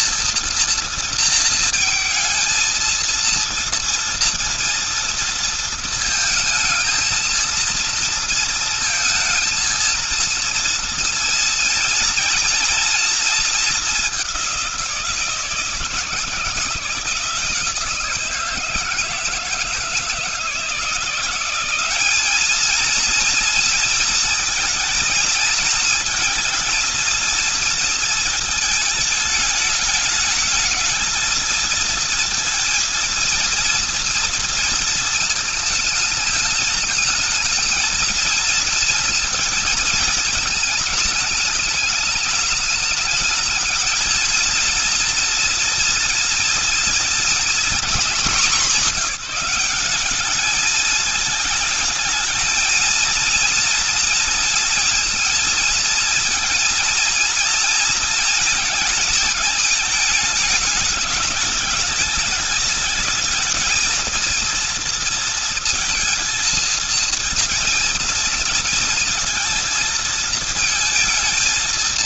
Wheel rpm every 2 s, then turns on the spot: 230, 230, 230, 230, 230, 230, 230, 190, 160, 160, 160, 220, 230, 220, 220, 220, 230, 230, 220, 230, 220, 220, 230, 230, 210, 210, 220, 230, 230, 220, 210, 210, 230, 230, 230, 220.
none